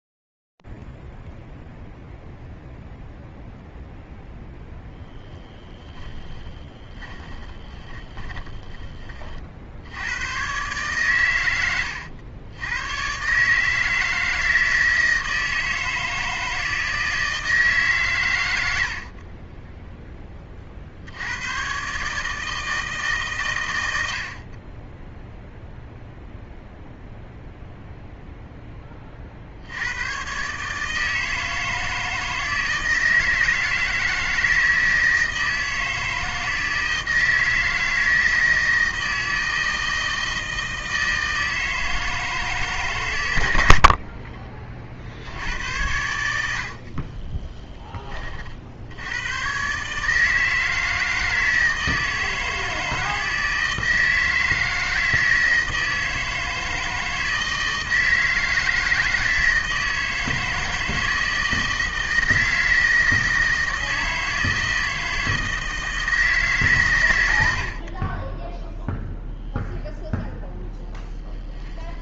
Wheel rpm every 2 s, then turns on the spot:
0, 0, 10, 20, 20, 130, 110, 160, 160, 80, 60, 160, 20, 0, 10, 150, 160, 160, 160, 160, 160, 140, 50, 60, 60, 160, 160, 160, 160, 160, 160, 160, 160, 130, 0, 0.
6-8 46-48